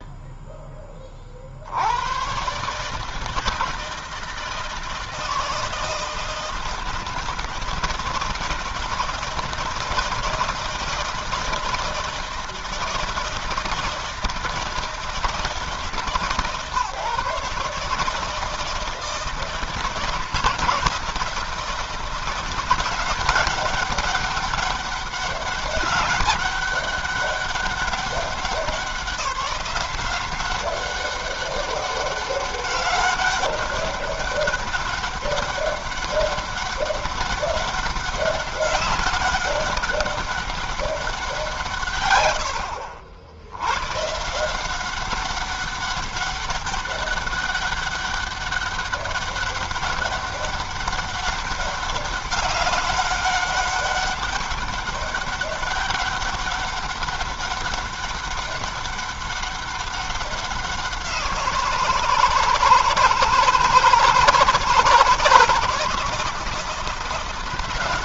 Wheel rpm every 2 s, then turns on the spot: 0, 120, 160, 160, 160, 160, 160, 160, 140, 160, 170, 170, 200, 200, 190, 190, 200, 200, 200, 200, 200, 90, 150, 200, 190, 200, 200, 200, 200, 200, 190, 160, 160, 160.
none